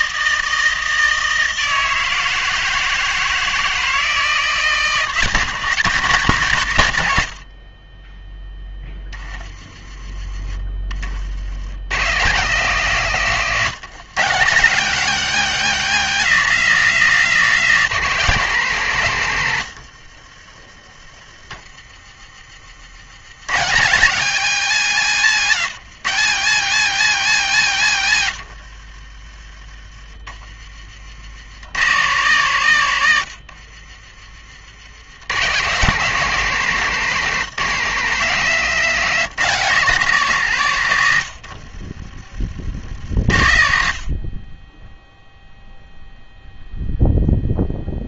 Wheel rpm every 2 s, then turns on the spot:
160, 160, 160, 110, 10, 40, 170, 170, 200, 170, 40, 50, 190, 180, 80, 40, 150, 80, 180, 170, 140, 70, 20, 0.
20-22 28-32